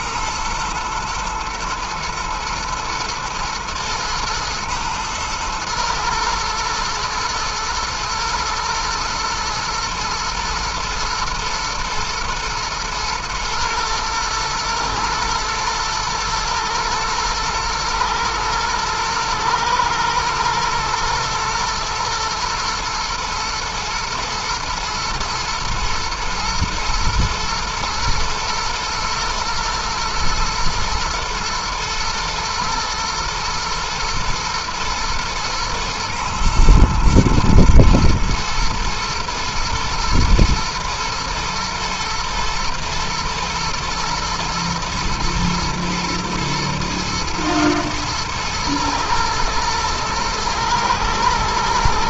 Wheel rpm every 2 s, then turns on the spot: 110, 110, 110, 110, 110, 120, 110, 110, 110, 110, 120, 120, 120, 110, 120, 120, 120, 120, 110, 110, 110, 110, 110, 110, 110, 110.
none